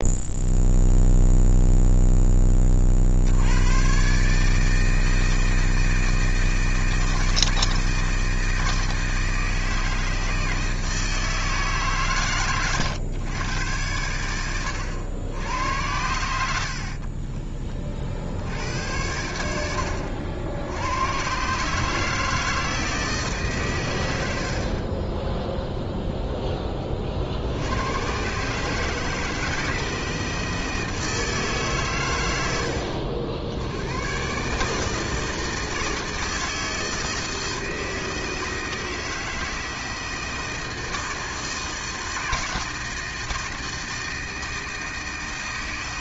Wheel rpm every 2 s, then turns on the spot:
0, 40, 160, 160, 160, 160, 110, 90, 40, 90, 100, 160, 30, 40, 160, 160, 70, 160, 160, 160, 160, 160, 160.
none